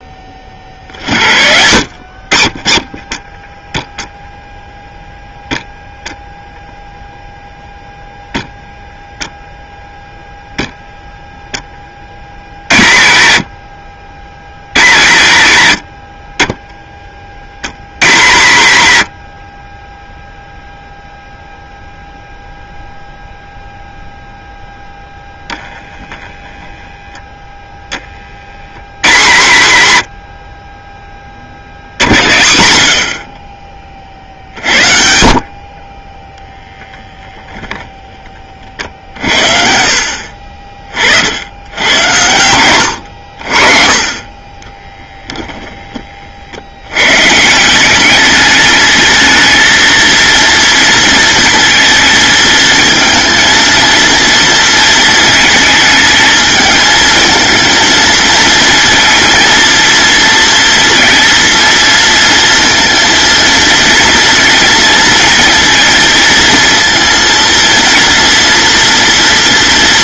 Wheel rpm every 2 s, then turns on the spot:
60, 10, 0, 0, 0, 0, 80, 140, 30, 110, 0, 0, 0, 0, 100, 30, 70, 60, 0, 60, 40, 100, 10, 100, 220, 230, 230, 230, 220, 230, 230, 230, 230, 230, 240.
44-46